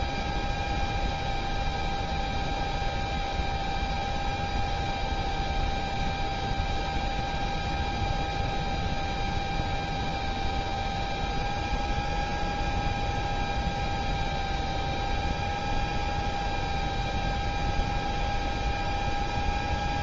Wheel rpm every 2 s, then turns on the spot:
0, 0, 0, 0, 0, 0, 0, 0, 0, 0.
none